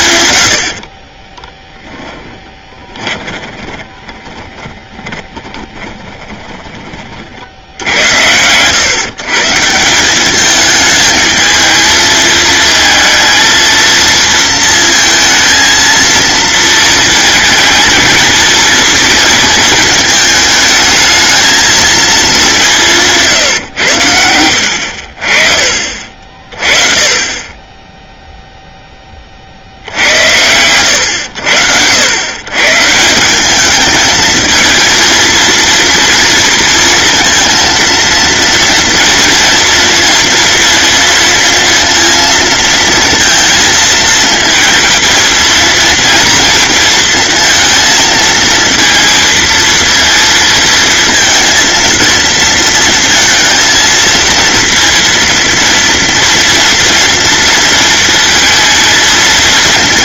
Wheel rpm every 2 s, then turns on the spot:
60, 20, 20, 40, 150, 220, 230, 230, 220, 230, 220, 160, 50, 40, 30, 90, 180, 230, 230, 230, 230, 230, 220, 230, 230, 230, 230, 230, 230, 220.
0-6